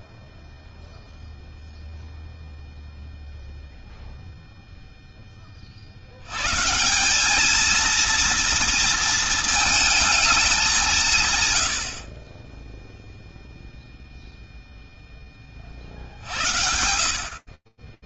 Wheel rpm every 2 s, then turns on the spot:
0, 0, 0, 70, 230, 220, 60, 0, 70.
none